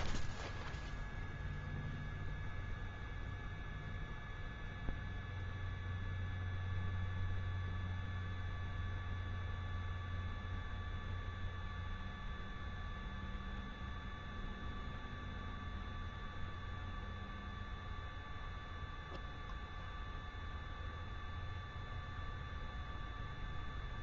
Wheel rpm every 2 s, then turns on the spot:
0, 0, 0, 0, 0, 0, 0, 0, 0, 0, 0, 0.
none